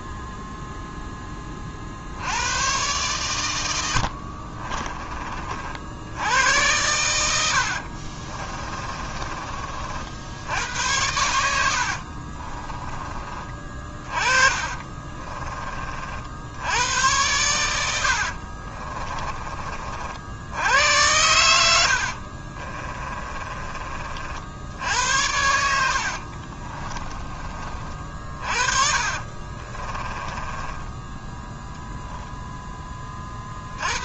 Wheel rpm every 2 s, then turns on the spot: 0, 110, 30, 100, 30, 90, 20, 30, 100, 30, 100, 30, 80, 20, 40, 20, 20.
8-16 18-20 22-24 26-32